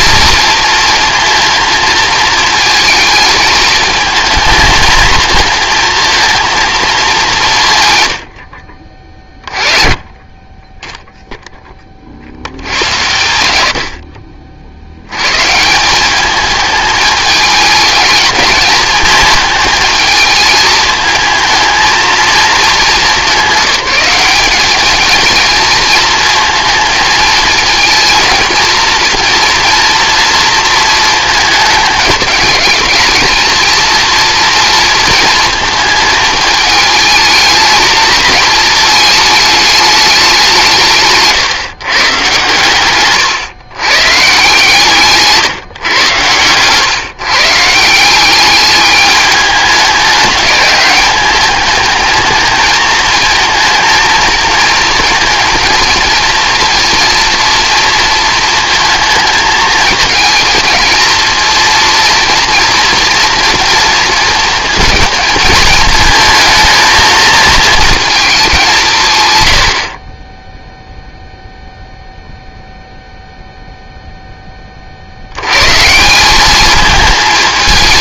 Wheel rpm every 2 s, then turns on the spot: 230, 220, 230, 210, 40, 10, 90, 70, 210, 220, 230, 210, 210, 220, 230, 220, 220, 230, 210, 220, 150, 120, 140, 130, 210, 200, 220, 220, 230, 220, 230, 230, 230, 220, 170, 0, 0, 40, 210.
42-44